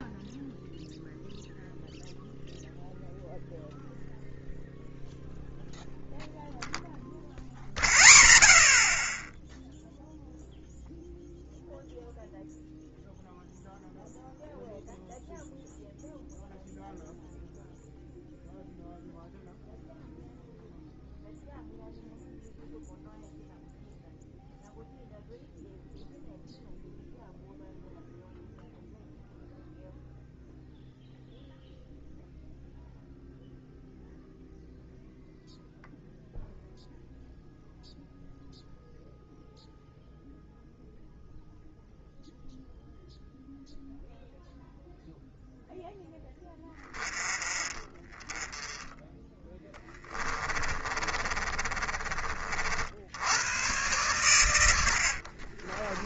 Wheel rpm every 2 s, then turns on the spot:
0, 0, 0, 0, 0, 0, 0, 0, 0, 0, 0, 0, 0, 0, 0, 0, 0, 0, 0, 0, 0, 0, 0, 20, 10, 30, 70, 90.
50-52